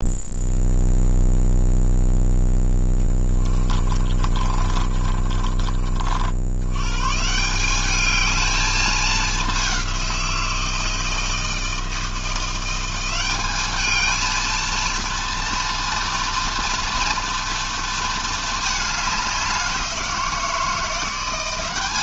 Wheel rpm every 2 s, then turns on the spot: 0, 10, 30, 130, 210, 160, 180, 230, 230, 200, 180.
2-6